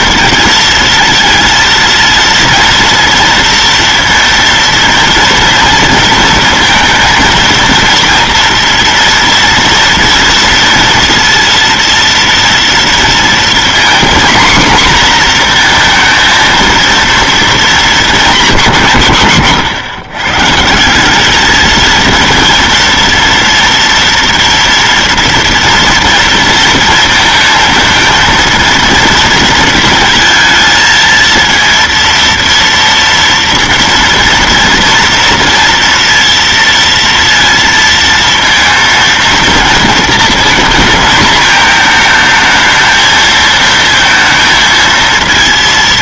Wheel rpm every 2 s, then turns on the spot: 230, 230, 230, 230, 230, 230, 230, 240, 230, 190, 160, 230, 230, 230, 230, 220, 230, 230, 230, 230, 230, 220, 230.
none